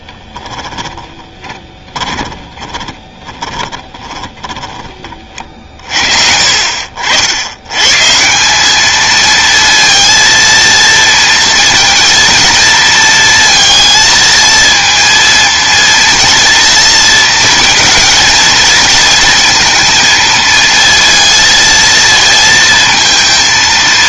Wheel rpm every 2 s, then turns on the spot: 30, 20, 30, 60, 210, 230, 230, 230, 230, 230, 230, 230.
0-4